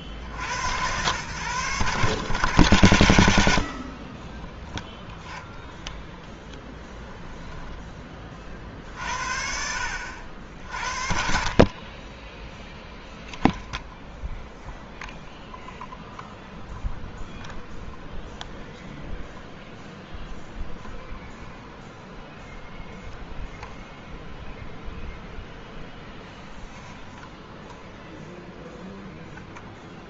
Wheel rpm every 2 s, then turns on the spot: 90, 120, 10, 10, 30, 50, 0, 0, 0, 0, 0, 0, 0, 0, 0.
6-8